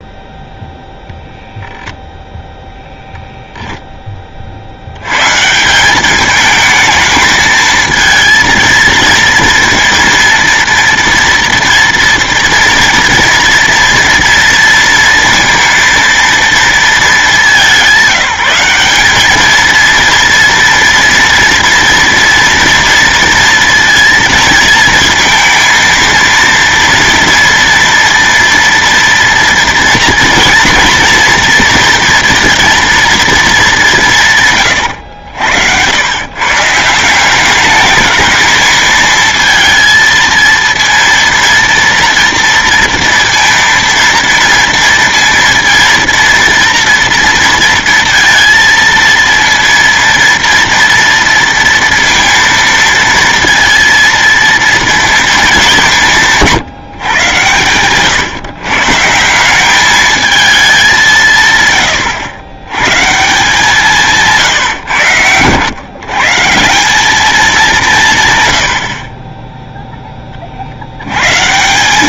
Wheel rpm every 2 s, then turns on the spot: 0, 0, 70, 220, 220, 230, 230, 230, 220, 190, 230, 230, 230, 230, 230, 230, 230, 110, 150, 220, 230, 230, 230, 230, 230, 230, 230, 230, 150, 140, 200, 120, 130, 180, 90, 60.
34-36